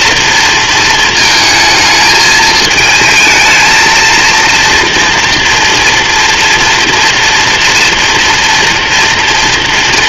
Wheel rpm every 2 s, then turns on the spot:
220, 220, 230, 230, 230.
none